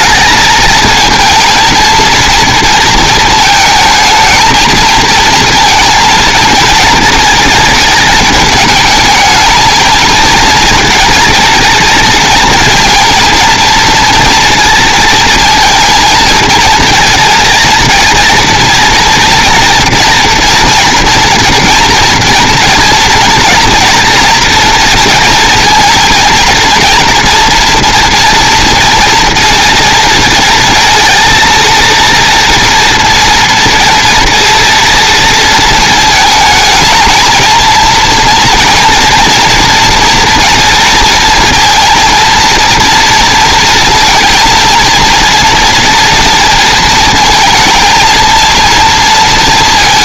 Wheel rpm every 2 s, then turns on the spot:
220, 230, 230, 230, 220, 230, 230, 230, 230, 230, 240, 240, 230, 230, 230, 230, 230, 230, 220, 230, 230, 230, 230, 230, 230.
none